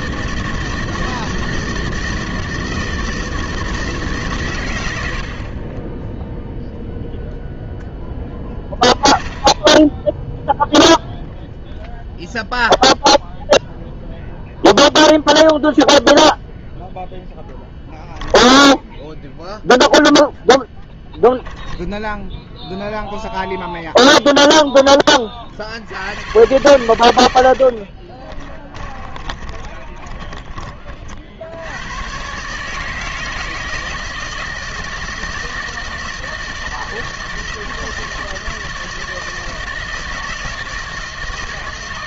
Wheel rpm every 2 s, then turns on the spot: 160, 160, 110, 0, 10, 0, 0, 0, 0, 0, 10, 0, 0, 110, 20, 30, 150, 160, 160, 160, 160.
28-30